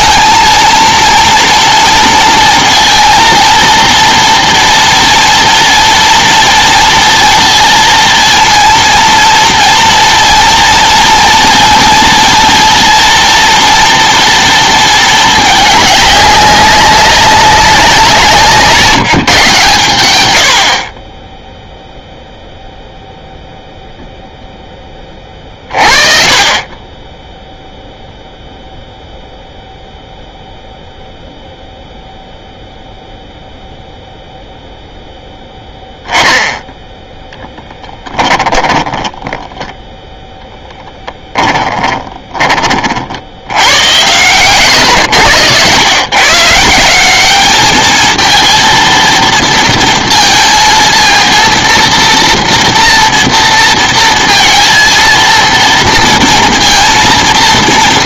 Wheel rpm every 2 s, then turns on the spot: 230, 230, 230, 230, 230, 230, 230, 230, 200, 170, 50, 0, 10, 20, 0, 0, 0, 0, 10, 10, 10, 40, 110, 170, 230, 230, 230, 230, 230.
38-42 44-46